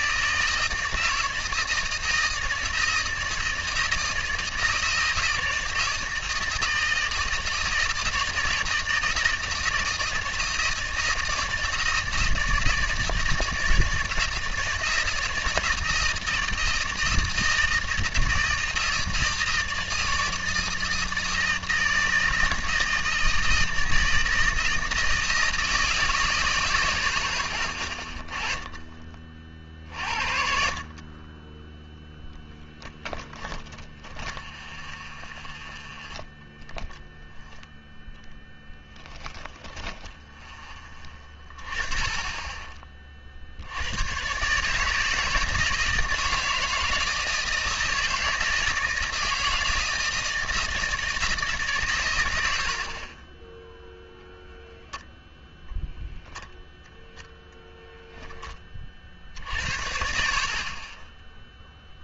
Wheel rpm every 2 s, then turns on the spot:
160, 160, 160, 160, 160, 160, 160, 160, 160, 160, 160, 160, 150, 10, 20, 50, 10, 0, 10, 10, 10, 30, 150, 160, 160, 170, 80, 0, 0, 30, 30.
26-28